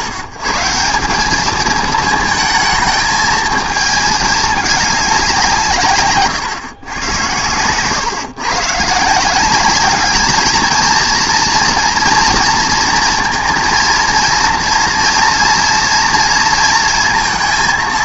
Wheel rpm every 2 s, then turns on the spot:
120, 220, 220, 140, 130, 220, 230, 230, 230.
none